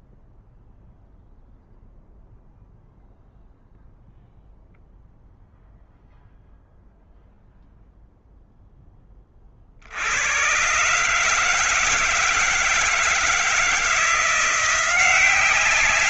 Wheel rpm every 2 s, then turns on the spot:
0, 0, 0, 0, 0, 100, 160, 170.
none